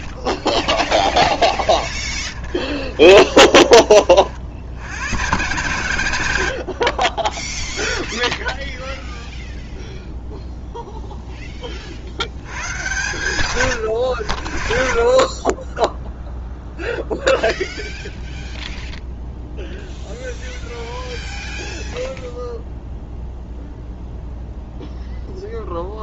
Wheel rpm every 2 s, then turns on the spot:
20, 40, 90, 70, 0, 0, 110, 50, 0, 0, 0, 0, 0.
0-4